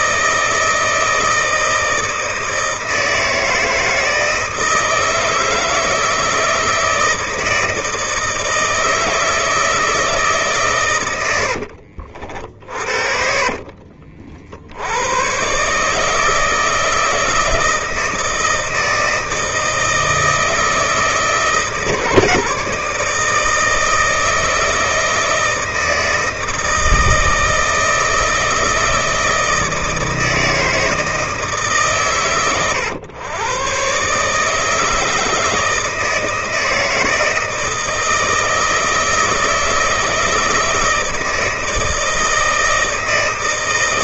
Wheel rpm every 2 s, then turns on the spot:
160, 160, 160, 160, 160, 140, 50, 60, 160, 160, 160, 150, 160, 160, 160, 160, 120, 150, 160, 160, 160, 160.
12-14